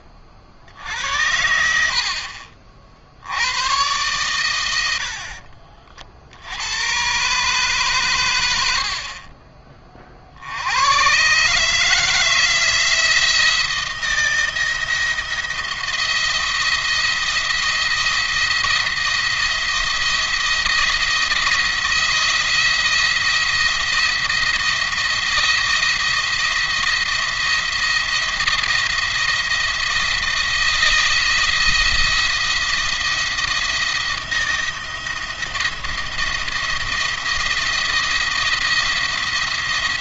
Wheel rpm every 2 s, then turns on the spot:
40, 50, 100, 80, 80, 80, 160, 170, 170, 170, 170, 170, 170, 170, 170, 170, 170, 170, 170, 170.
none